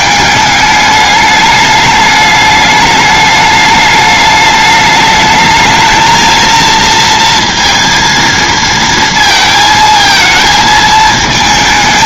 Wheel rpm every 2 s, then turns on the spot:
210, 210, 210, 230, 230, 220.
none